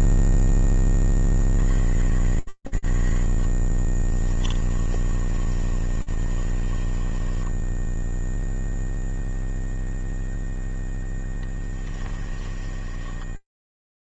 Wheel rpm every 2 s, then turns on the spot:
20, 30, 30, 0, 0, 20, 0.
2-6 10-12